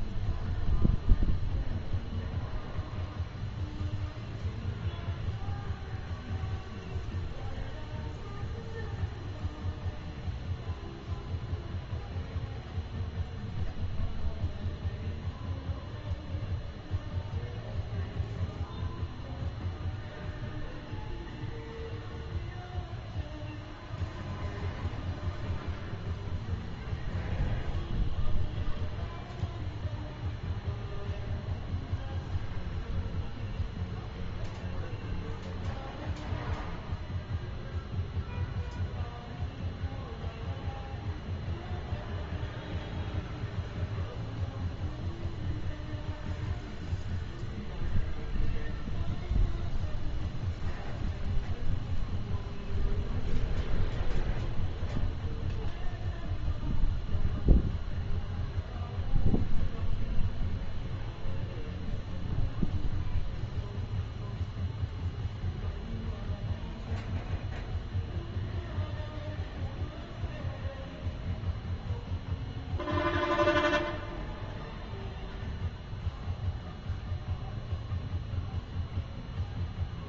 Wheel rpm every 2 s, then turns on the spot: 0, 0, 0, 0, 0, 0, 0, 0, 0, 0, 0, 0, 0, 0, 0, 0, 0, 0, 0, 0, 0, 0, 0, 0, 0, 0, 0, 0, 0, 0, 0, 0, 0, 0, 0, 0, 0, 0, 0, 0.
none